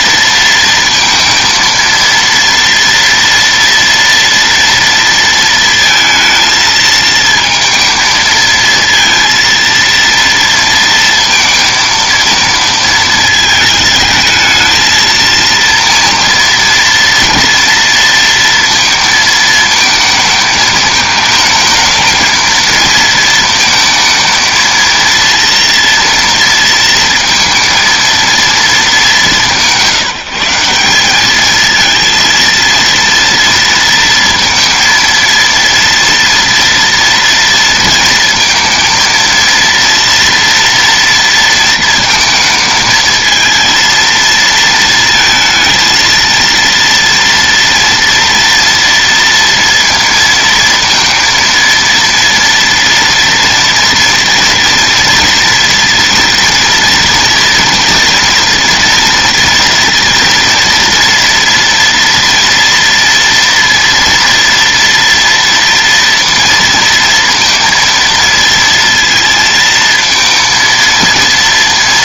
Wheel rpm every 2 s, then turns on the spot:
230, 230, 230, 220, 230, 230, 220, 220, 230, 230, 220, 220, 230, 230, 220, 180, 230, 230, 230, 230, 230, 220, 230, 230, 230, 230, 230, 240, 230, 230, 230, 230, 230, 230, 230, 230.
none